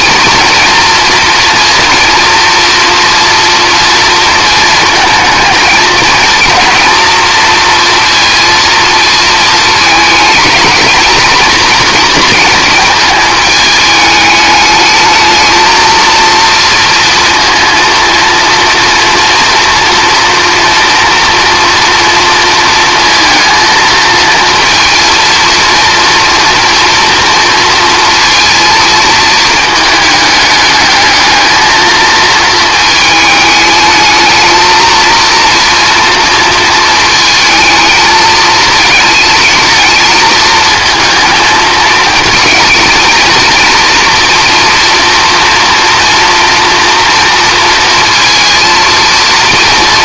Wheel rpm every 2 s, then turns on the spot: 230, 230, 220, 230, 230, 220, 220, 210, 230, 230, 230, 230, 230, 230, 230, 210, 220, 220, 230, 220, 230, 230, 230, 230, 230.
none